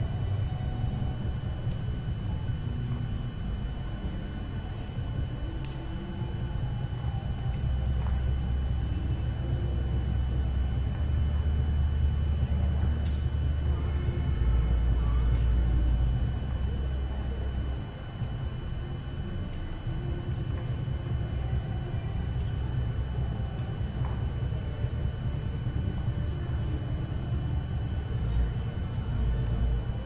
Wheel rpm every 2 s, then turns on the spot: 0, 0, 0, 0, 0, 0, 0, 0, 0, 0, 0, 0, 0, 0, 0.
none